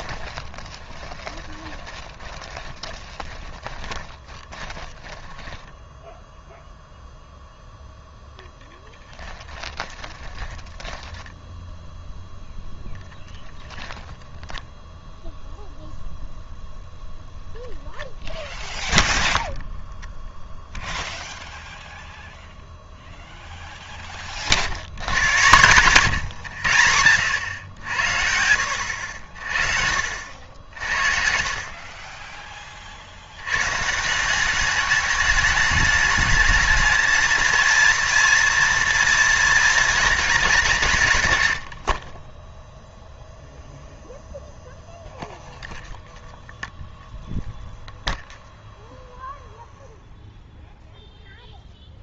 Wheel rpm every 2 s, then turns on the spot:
20, 20, 20, 0, 10, 20, 0, 10, 0, 0, 0, 0, 70, 100, 80, 70, 30, 200, 220, 240, 190, 0, 0, 0, 0, 0.
0-6 10-12